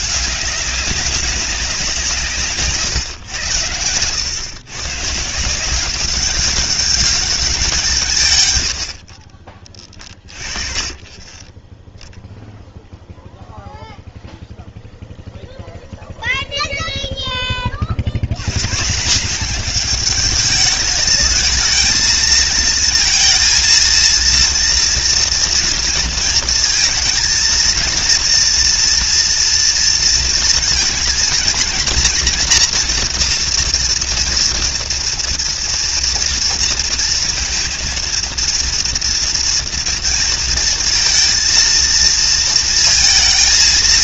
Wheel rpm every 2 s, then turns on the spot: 200, 130, 140, 200, 90, 40, 0, 0, 0, 140, 220, 230, 230, 230, 240, 220, 230, 230, 230, 230, 230, 230.
none